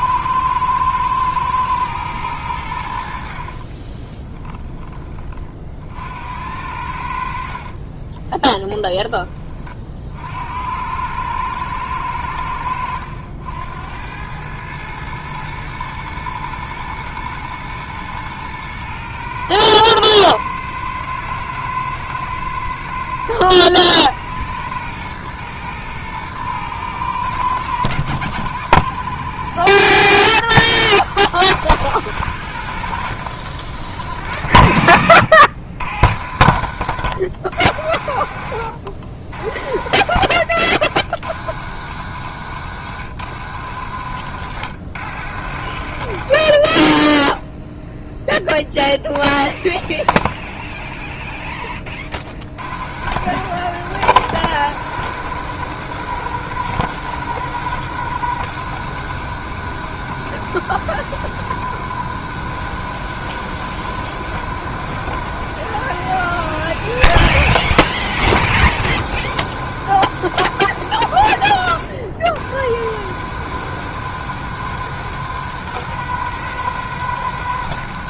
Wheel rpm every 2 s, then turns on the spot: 110, 90, 20, 70, 10, 80, 90, 110, 120, 110, 120, 70, 90, 110, 100, 80, 100, 80, 100, 70, 90, 100, 100, 40, 0, 0, 20, 120, 120, 120, 120, 120, 120, 140, 130, 120, 100, 120, 120.
none